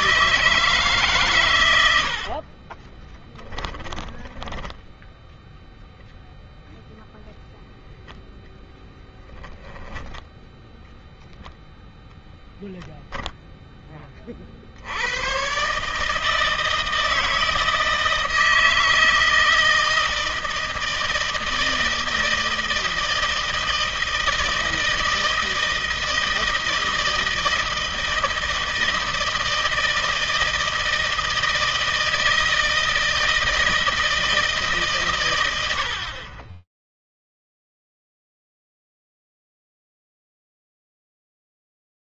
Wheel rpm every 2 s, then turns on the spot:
140, 20, 10, 0, 10, 0, 0, 100, 160, 160, 160, 160, 160, 160, 160, 160, 160, 130, 0, 0, 0.
2-4